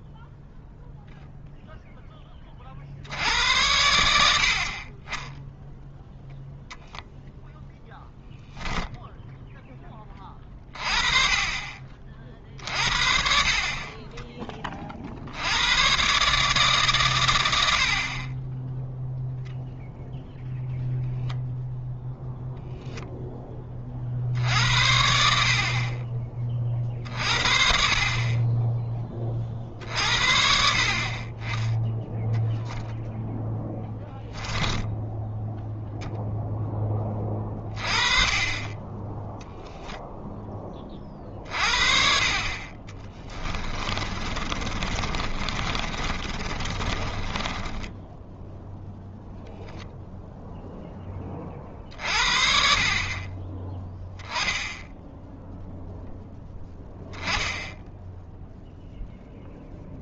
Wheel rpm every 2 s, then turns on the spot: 0, 50, 40, 0, 0, 30, 50, 30, 140, 10, 0, 10, 70, 40, 20, 50, 0, 10, 10, 20, 20, 30, 30, 20, 0, 0, 40, 10, 10, 0.
42-48